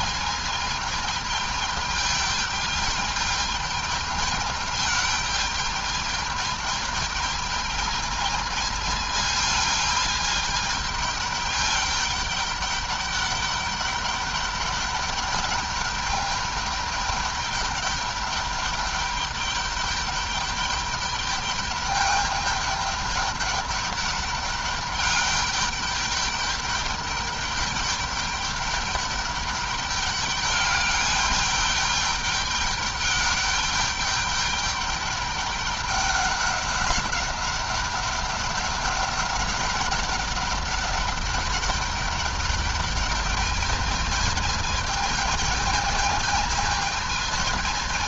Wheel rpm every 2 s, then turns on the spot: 220, 210, 210, 220, 220, 210, 200, 200, 210, 200, 200, 210, 200, 200, 200, 200, 210, 200, 200, 200, 200, 210, 220, 220.
none